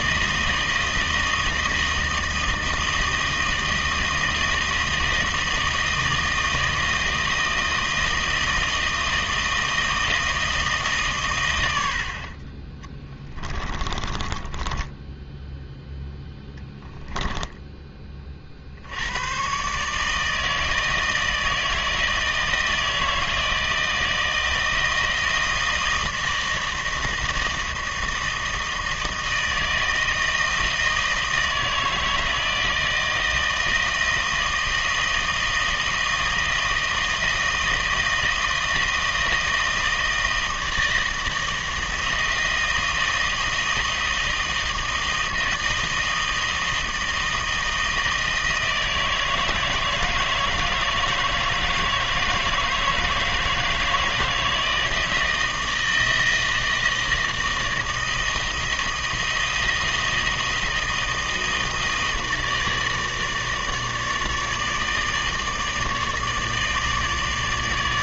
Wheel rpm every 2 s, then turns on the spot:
160, 160, 160, 160, 160, 150, 20, 20, 10, 70, 160, 160, 160, 160, 160, 160, 160, 160, 160, 160, 160, 160, 160, 160, 160, 160, 160, 160, 160, 160, 160, 160, 160, 150.
12-16